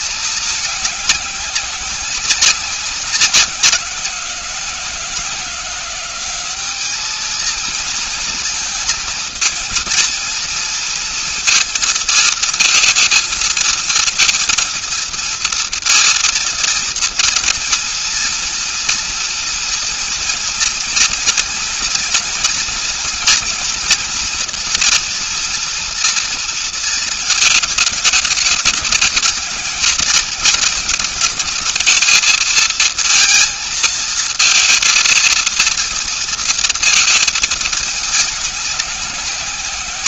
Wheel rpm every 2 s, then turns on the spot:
190, 180, 200, 230, 230, 230, 230, 230, 230, 230, 230, 240, 230, 210, 220, 220, 230, 230, 210, 140.
none